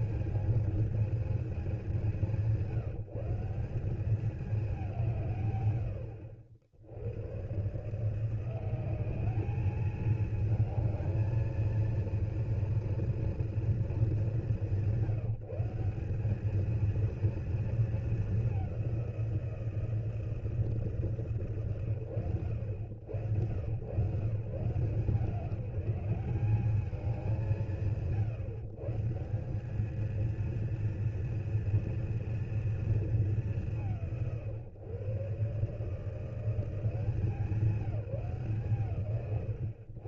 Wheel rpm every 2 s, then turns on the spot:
220, 150, 200, 80, 180, 220, 230, 200, 200, 200, 160, 110, 140, 190, 150, 230, 240, 130, 170, 160.
none